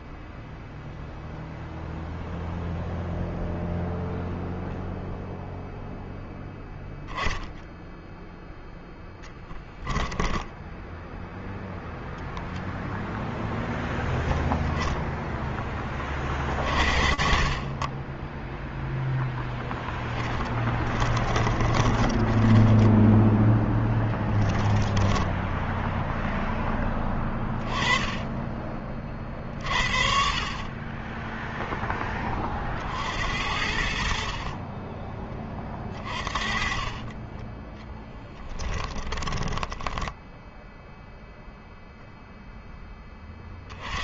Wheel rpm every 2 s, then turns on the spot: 0, 0, 0, 0, 10, 0, 0, 10, 30, 0, 40, 10, 10, 10, 40, 10, 70, 30, 30, 10, 0, 10.
8-10 20-22 24-26 34-40